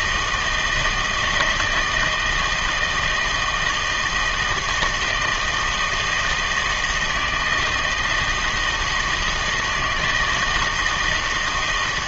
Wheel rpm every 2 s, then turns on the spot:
160, 160, 160, 160, 160, 160.
none